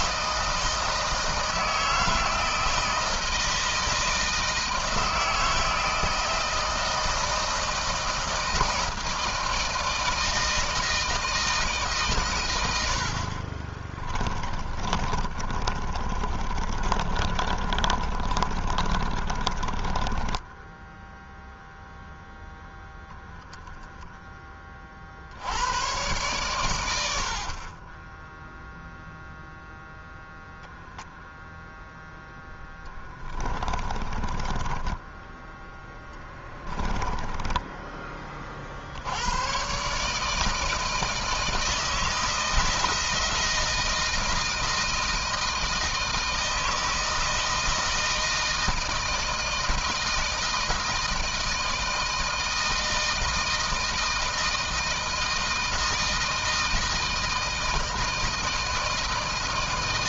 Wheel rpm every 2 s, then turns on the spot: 160, 160, 160, 160, 160, 160, 100, 30, 30, 30, 10, 0, 30, 100, 0, 0, 10, 20, 20, 50, 160, 160, 160, 160, 160, 160, 160, 160, 160, 160.
14-20 32-38